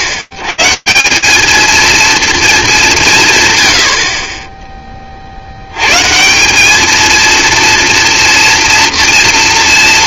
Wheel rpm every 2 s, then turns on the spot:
130, 210, 30, 210, 230.
none